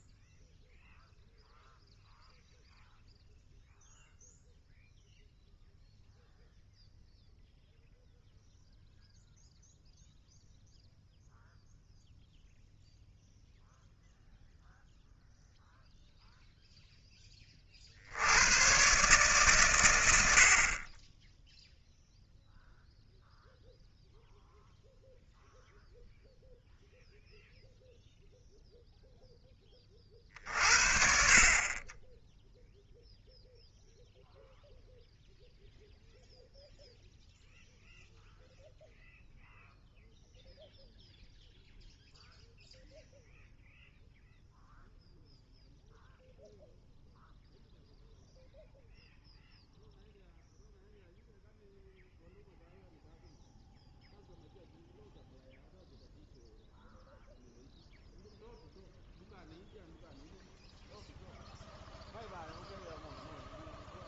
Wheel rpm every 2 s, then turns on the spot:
0, 0, 0, 0, 0, 0, 0, 0, 0, 110, 50, 0, 0, 0, 0, 50, 0, 0, 0, 0, 0, 0, 0, 0, 0, 0, 0, 0, 0, 0, 0, 0.
none